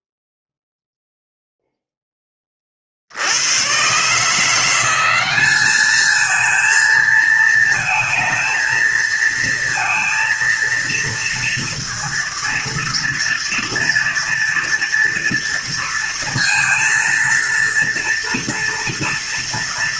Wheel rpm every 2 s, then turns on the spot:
0, 30, 170, 220, 230, 230, 230, 230, 230, 240.
none